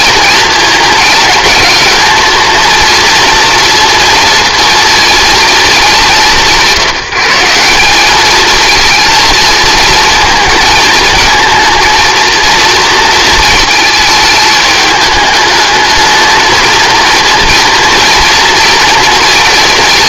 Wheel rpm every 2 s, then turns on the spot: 220, 230, 230, 170, 230, 220, 220, 210, 230, 230.
none